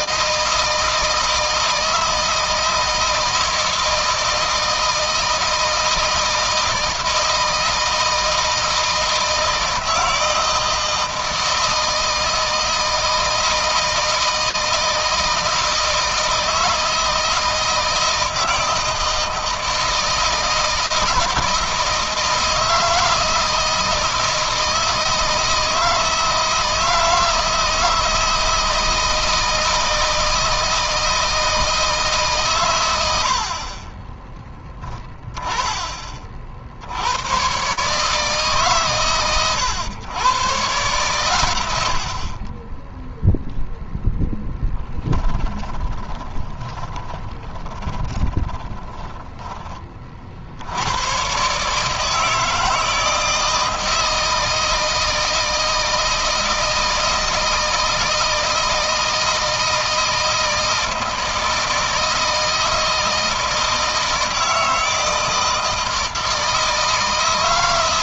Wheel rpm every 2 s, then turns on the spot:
160, 160, 160, 160, 160, 160, 160, 160, 160, 160, 160, 160, 160, 160, 160, 160, 90, 20, 90, 130, 120, 10, 10, 20, 10, 110, 160, 160, 160, 160, 160, 160, 160, 160.
44-50